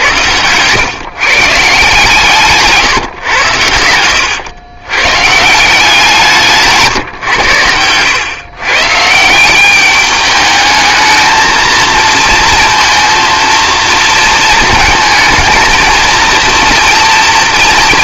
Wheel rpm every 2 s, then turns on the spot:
120, 140, 110, 150, 130, 210, 230, 220, 230.
2-4